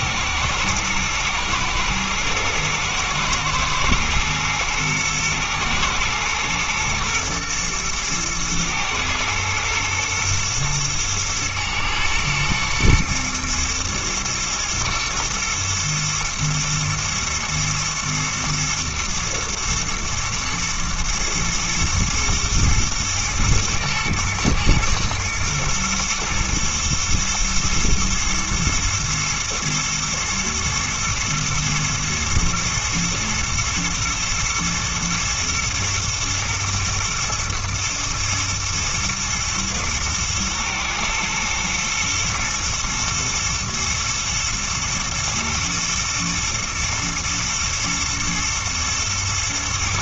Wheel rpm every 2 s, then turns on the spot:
110, 110, 110, 120, 110, 110, 110, 110, 110, 110, 110, 120, 120, 110, 110, 120, 110, 110, 110, 110, 110, 120, 120, 110, 120.
none